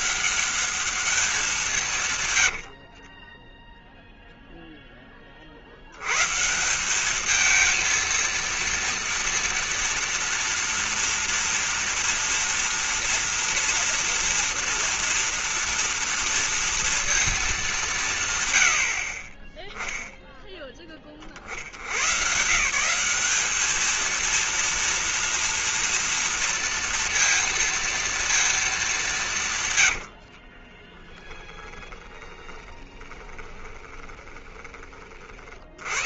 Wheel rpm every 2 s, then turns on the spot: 200, 80, 0, 170, 230, 230, 230, 230, 230, 120, 10, 140, 230, 230, 220, 40, 20, 20.
2-4 30-36